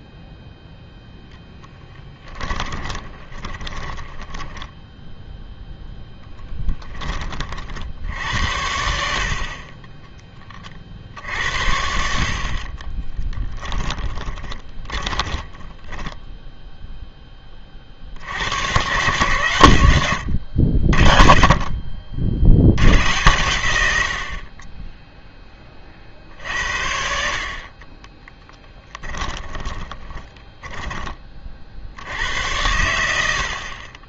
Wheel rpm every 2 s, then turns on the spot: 0, 20, 10, 10, 80, 40, 40, 20, 0, 110, 70, 80, 30, 60, 10, 20, 90.
2-4 12-16 28-32